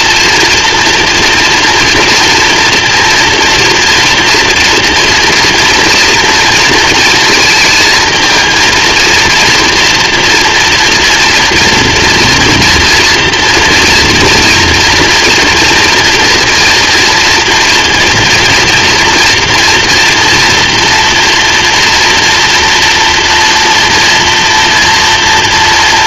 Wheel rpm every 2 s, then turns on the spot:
230, 230, 240, 230, 230, 230, 240, 230, 230, 230, 230, 240, 230.
none